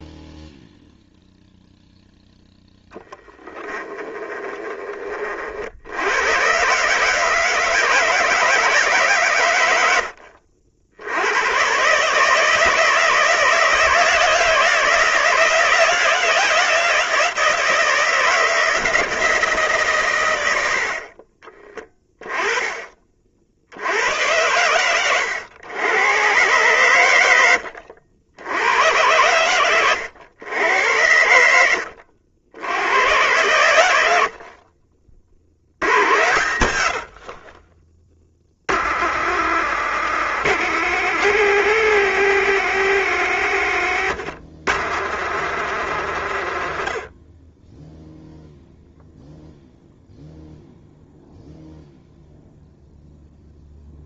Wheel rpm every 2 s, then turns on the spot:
0, 0, 10, 100, 160, 70, 150, 160, 170, 160, 100, 10, 90, 110, 80, 100, 70, 60, 90, 50, 150, 140, 110, 110, 0, 0, 0.
none